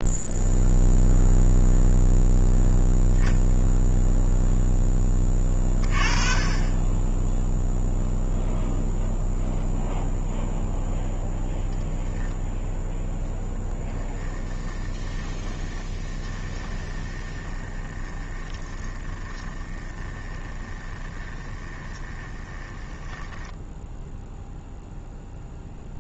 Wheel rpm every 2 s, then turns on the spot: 0, 0, 0, 20, 0, 0, 0, 20, 20, 30, 20, 10, 0.
14-24